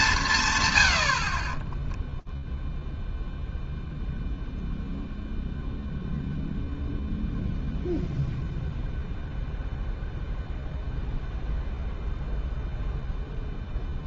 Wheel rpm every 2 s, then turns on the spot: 60, 0, 0, 0, 0, 0, 0.
none